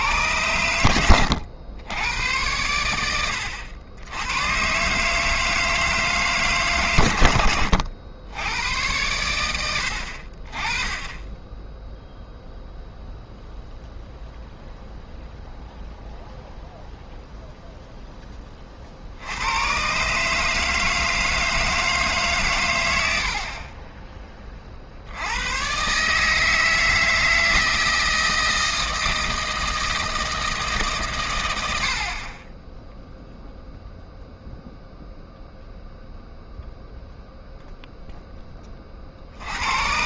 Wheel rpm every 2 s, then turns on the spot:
100, 90, 120, 140, 100, 30, 0, 0, 0, 30, 150, 120, 40, 160, 160, 160, 20, 0, 0, 10.
none